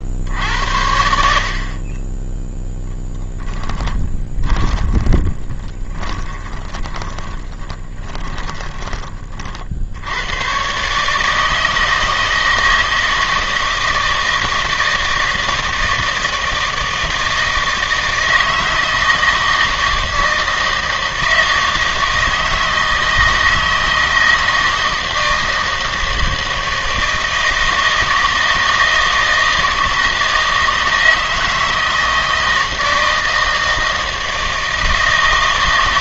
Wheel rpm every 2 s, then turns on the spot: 80, 0, 20, 20, 10, 120, 160, 160, 160, 160, 160, 160, 160, 160, 160, 160, 160, 160.
4-10